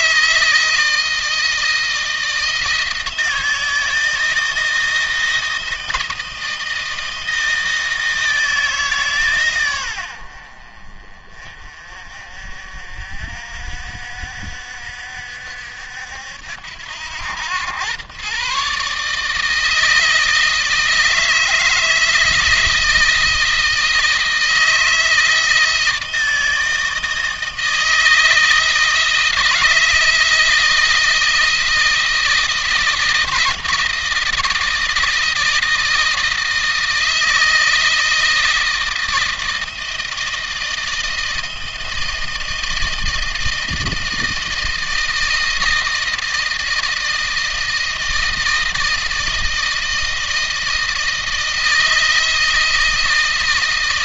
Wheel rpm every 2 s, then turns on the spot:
160, 160, 160, 160, 160, 50, 50, 60, 80, 130, 160, 160, 160, 160, 160, 160, 160, 160, 160, 160, 160, 160, 160, 160, 160, 160, 160.
none